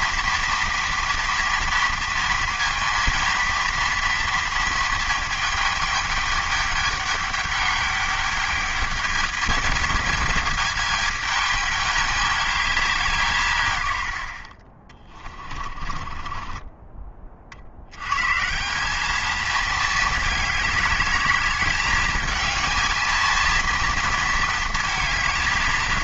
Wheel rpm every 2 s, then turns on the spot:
240, 230, 230, 210, 210, 220, 210, 60, 20, 170, 210, 220, 220.
16-18